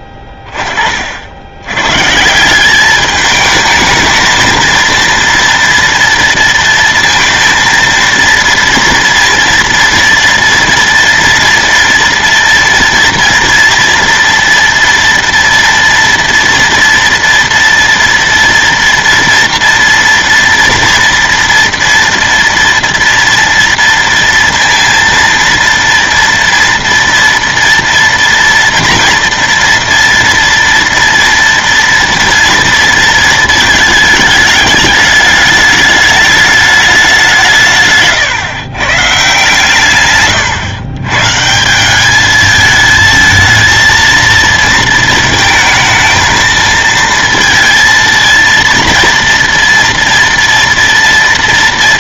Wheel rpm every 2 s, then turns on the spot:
20, 200, 230, 230, 230, 240, 230, 230, 230, 230, 230, 240, 230, 230, 230, 230, 230, 210, 210, 130, 130, 220, 230, 230, 230, 230.
none